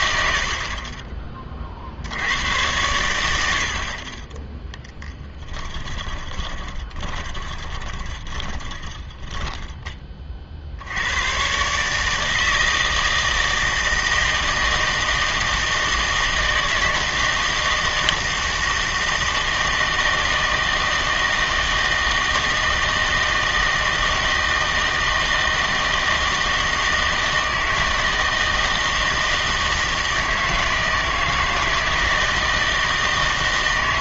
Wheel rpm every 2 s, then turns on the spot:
30, 90, 10, 20, 10, 70, 160, 160, 160, 160, 160, 160, 160, 160, 160, 160, 160.
6-10